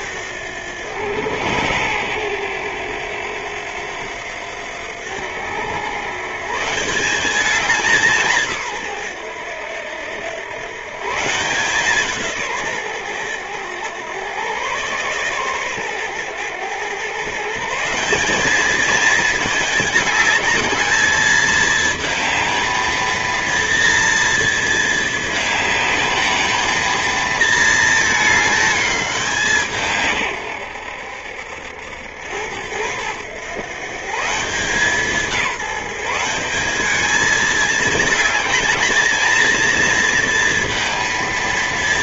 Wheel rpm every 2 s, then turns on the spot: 110, 90, 100, 190, 100, 160, 100, 130, 140, 220, 220, 230, 220, 230, 180, 70, 100, 170, 210, 220, 230.
none